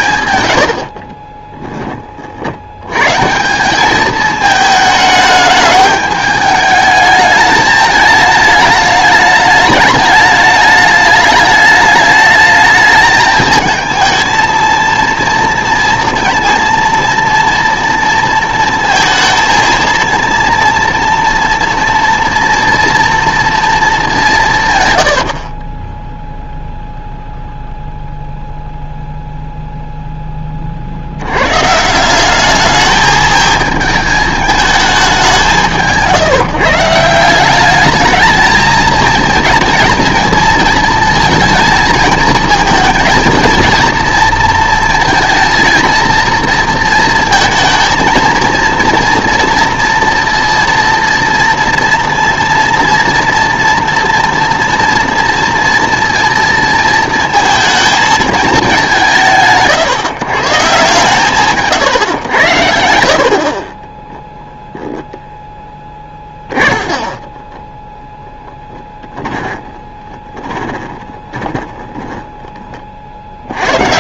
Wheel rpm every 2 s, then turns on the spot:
80, 70, 220, 210, 210, 210, 220, 230, 230, 230, 230, 230, 140, 0, 0, 30, 210, 210, 160, 220, 220, 220, 230, 230, 230, 230, 230, 230, 230, 210, 150, 80, 0, 30, 10, 20, 20.
0-2 24-26 66-72